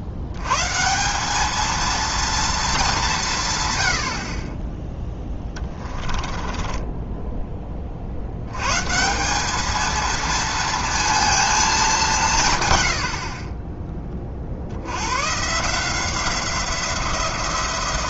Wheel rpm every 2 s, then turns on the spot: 160, 200, 10, 20, 140, 230, 100, 80, 180.
6-8